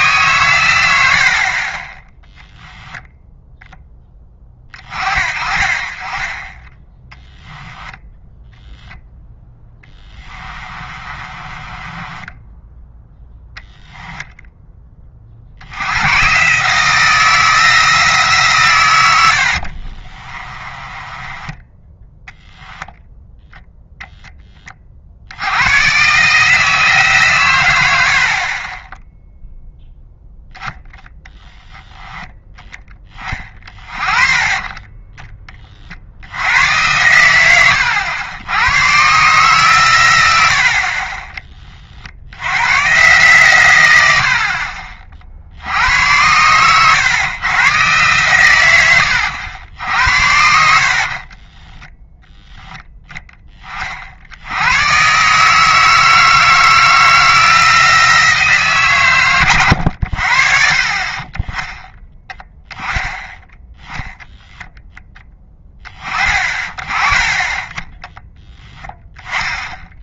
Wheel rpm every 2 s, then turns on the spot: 90, 0, 40, 10, 0, 30, 10, 10, 150, 130, 30, 10, 30, 160, 20, 0, 10, 20, 100, 110, 70, 110, 50, 110, 100, 70, 0, 90, 160, 140, 50, 10, 0, 30, 10.
10-12 20-22 50-52 66-68